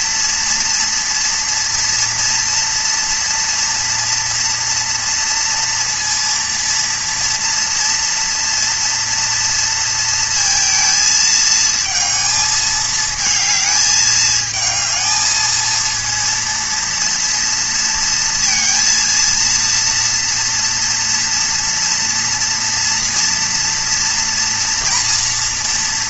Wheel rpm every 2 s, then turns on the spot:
230, 230, 230, 230, 230, 220, 220, 220, 230, 230, 230, 230, 230.
none